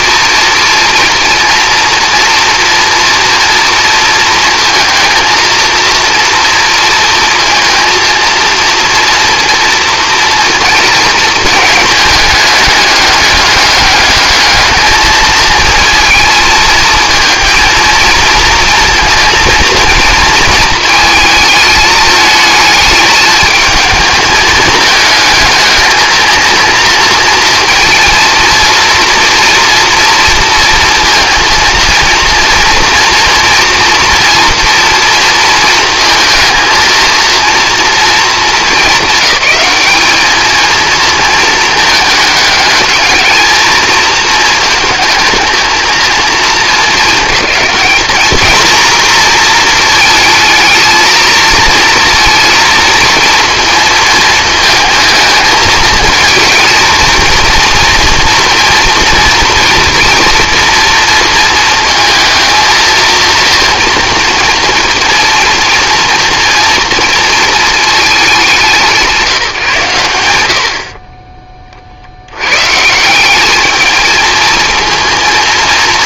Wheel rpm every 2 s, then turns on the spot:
230, 230, 230, 230, 230, 230, 210, 220, 230, 230, 220, 220, 220, 220, 230, 230, 230, 230, 230, 200, 220, 220, 220, 220, 240, 220, 230, 220, 230, 230, 230, 220, 230, 230, 170, 70, 130, 230.
none